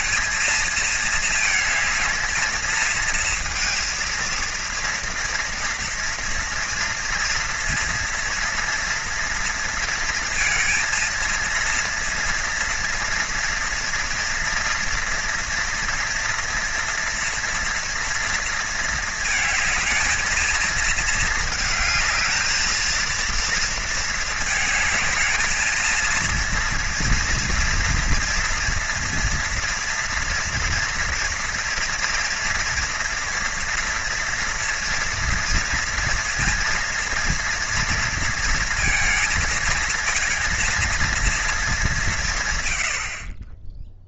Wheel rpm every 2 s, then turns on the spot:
220, 230, 230, 230, 230, 230, 230, 230, 230, 220, 220, 220, 220, 230, 230, 240, 240, 230, 230, 220, 230, 90.
none